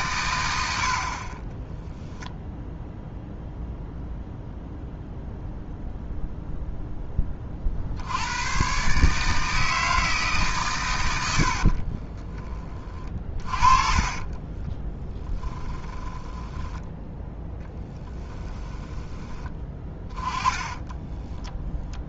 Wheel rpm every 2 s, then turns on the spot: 70, 0, 0, 0, 130, 140, 30, 20, 10, 10, 20.
12-16 18-22